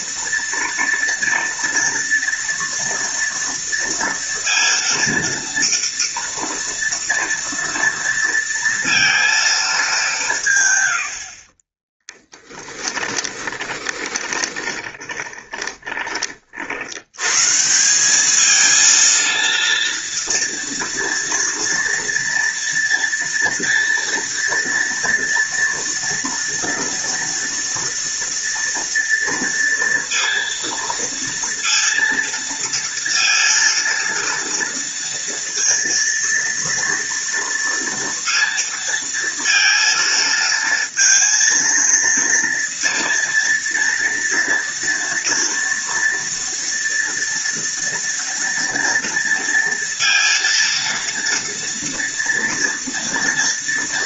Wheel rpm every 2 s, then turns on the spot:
230, 230, 230, 230, 230, 70, 20, 20, 100, 230, 230, 230, 230, 230, 230, 230, 230, 230, 230, 230, 230, 230, 240, 230, 230, 230, 230.
12-16